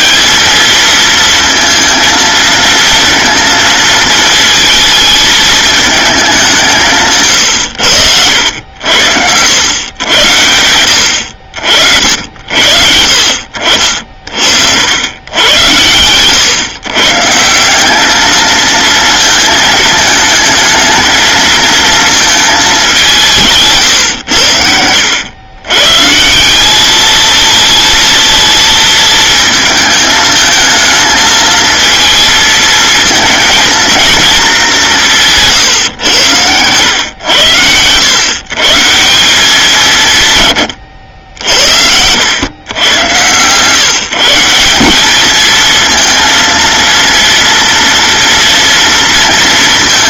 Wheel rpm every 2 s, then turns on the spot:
220, 230, 220, 150, 80, 80, 60, 80, 130, 220, 220, 200, 90, 210, 220, 220, 220, 200, 120, 160, 100, 110, 190, 230, 230.
none